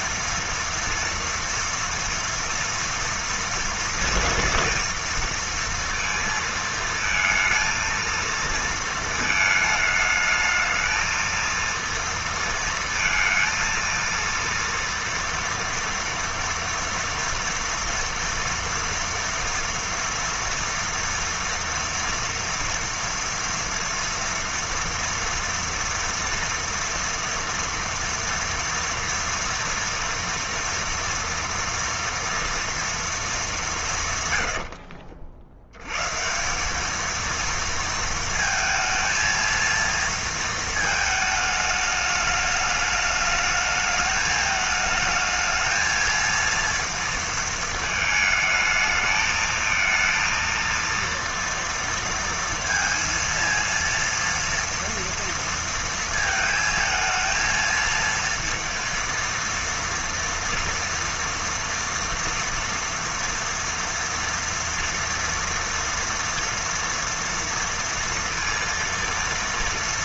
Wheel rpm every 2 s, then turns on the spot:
230, 240, 240, 220, 230, 220, 230, 230, 230, 230, 230, 230, 230, 230, 230, 230, 230, 60, 210, 230, 220, 210, 220, 230, 220, 230, 230, 230, 220, 230, 230, 230, 230, 230, 230.
34-36